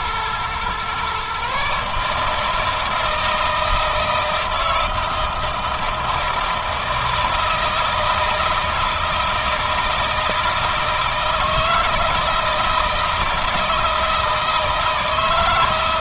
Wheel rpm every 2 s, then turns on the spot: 130, 160, 160, 160, 170, 160, 160, 160.
none